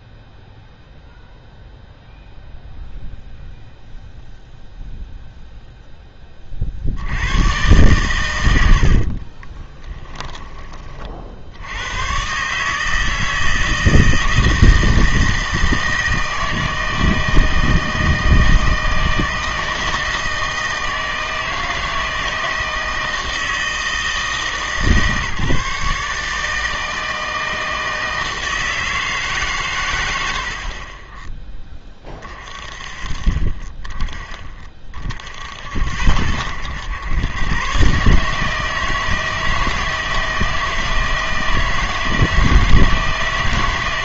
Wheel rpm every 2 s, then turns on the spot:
0, 0, 0, 50, 70, 20, 150, 160, 160, 160, 160, 160, 160, 160, 160, 50, 30, 30, 90, 160, 160, 160.
none